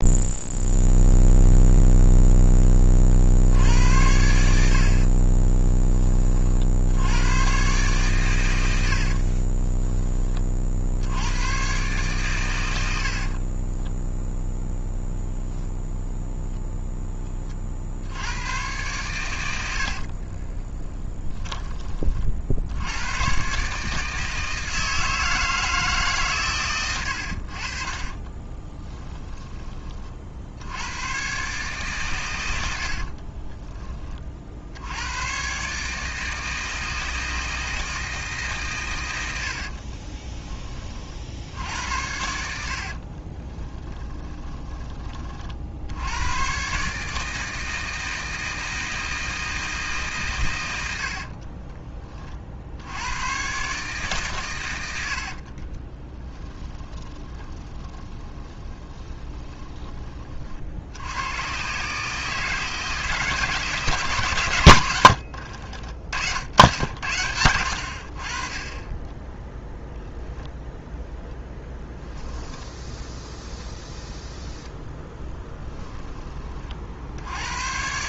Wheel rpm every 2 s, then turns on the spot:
0, 30, 60, 70, 80, 60, 80, 0, 0, 110, 10, 80, 160, 110, 20, 90, 70, 80, 160, 120, 30, 50, 20, 140, 160, 100, 80, 100, 20, 20, 70, 160, 90, 80, 20, 0, 10, 0, 50.
4-6 8-10 20-22 26-30 32-34 42-44 56-60 72-74